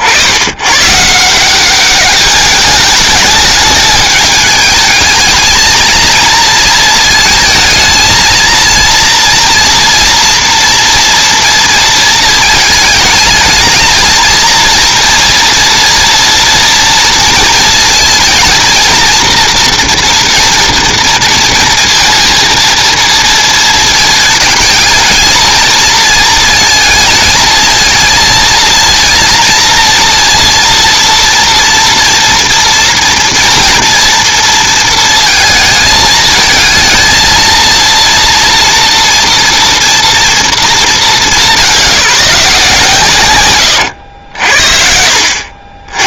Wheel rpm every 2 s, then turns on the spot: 90, 210, 220, 230, 230, 230, 220, 230, 230, 230, 230, 220, 220, 220, 230, 230, 230, 230, 220, 230, 220, 170, 70.
none